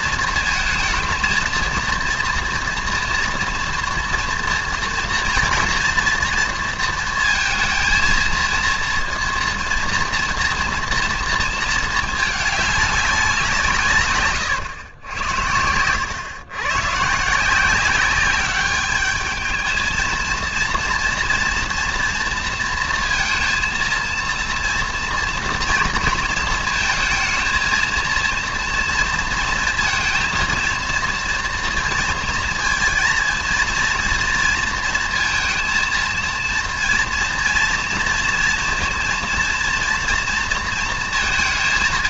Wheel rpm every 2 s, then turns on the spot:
230, 230, 230, 230, 230, 230, 210, 120, 120, 200, 230, 230, 230, 230, 230, 230, 230, 230, 230, 230, 230.
none